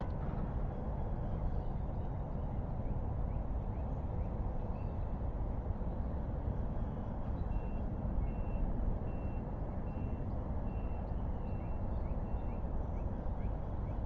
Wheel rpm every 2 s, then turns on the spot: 0, 0, 0, 0, 0, 0, 0.
none